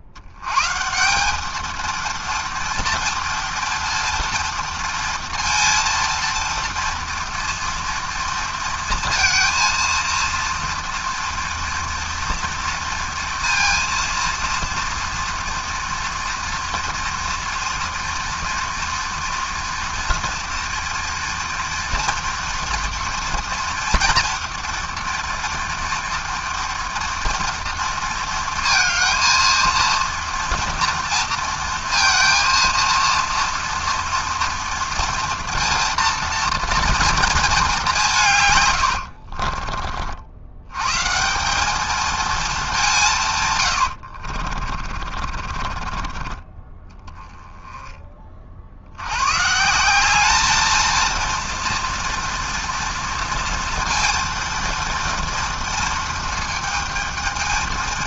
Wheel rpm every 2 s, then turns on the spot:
120, 230, 230, 230, 230, 230, 230, 230, 230, 230, 230, 230, 230, 230, 230, 230, 230, 230, 230, 120, 100, 210, 40, 20, 60, 220, 230, 230, 220.
44-46